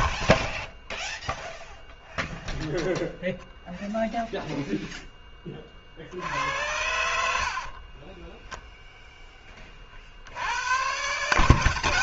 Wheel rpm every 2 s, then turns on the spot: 0, 0, 0, 70, 0, 80.
none